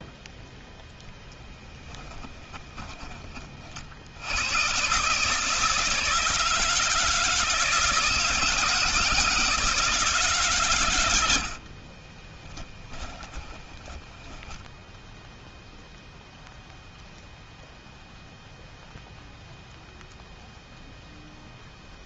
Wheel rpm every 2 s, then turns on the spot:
10, 30, 140, 160, 170, 80, 20, 0, 0, 0, 0.
10-14